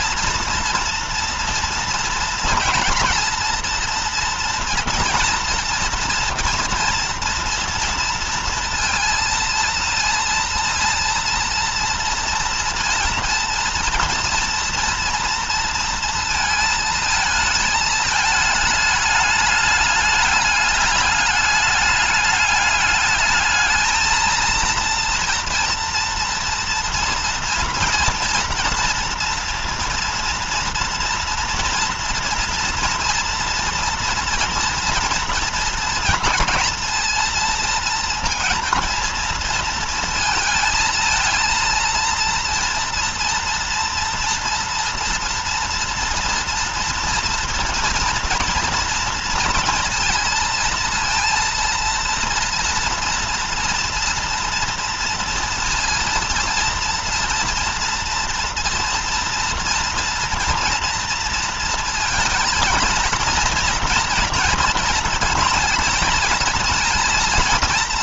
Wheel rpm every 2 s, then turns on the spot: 240, 230, 230, 230, 230, 230, 230, 230, 230, 210, 210, 210, 220, 230, 230, 230, 230, 230, 230, 230, 220, 230, 230, 230, 230, 230, 230, 230, 230, 240, 230, 230, 230, 230.
none